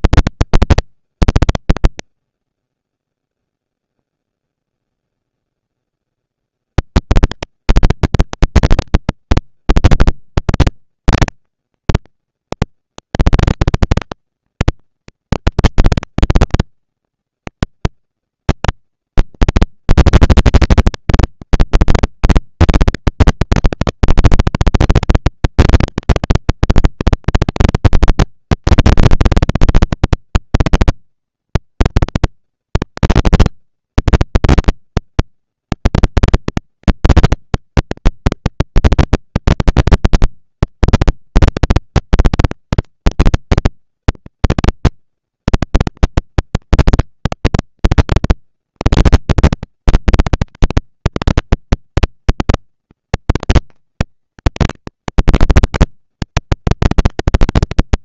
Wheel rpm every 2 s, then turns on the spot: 210, 100, 10, 80, 220, 190, 200, 230, 120, 210, 220, 230, 230, 230, 230, 230, 230, 230, 230, 230, 210, 190, 220, 230, 230, 230, 240, 230, 230.
2-6